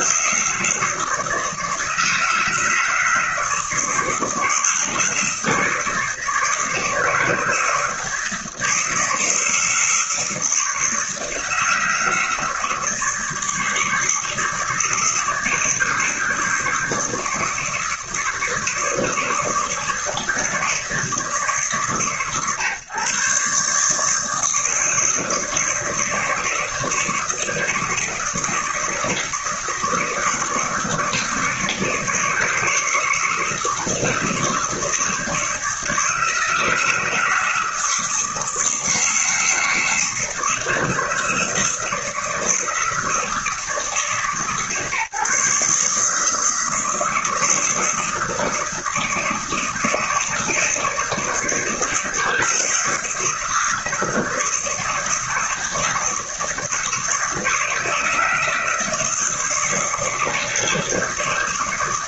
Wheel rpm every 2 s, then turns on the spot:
150, 160, 160, 150, 160, 160, 160, 160, 160, 160, 160, 130, 160, 160, 160, 160, 160, 160, 160, 160, 160, 160, 150, 160, 160, 160, 160, 160, 160, 160, 160.
none